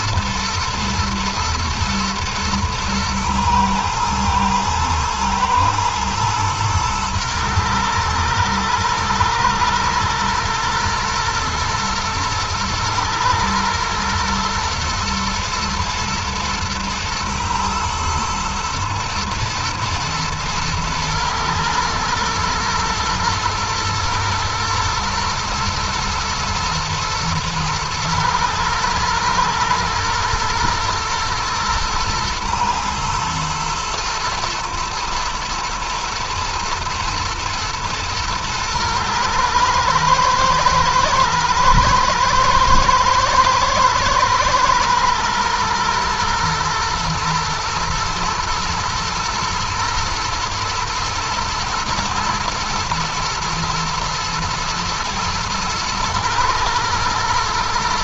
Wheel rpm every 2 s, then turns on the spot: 120, 110, 110, 110, 110, 120, 110, 110, 110, 110, 120, 110, 120, 110, 110, 120, 110, 110, 120, 120, 110, 110, 110, 120, 120, 110, 120, 110, 120.
none